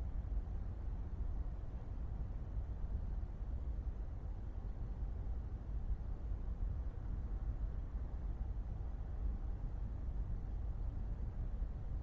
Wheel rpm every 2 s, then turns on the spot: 0, 0, 0, 0, 0, 0.
none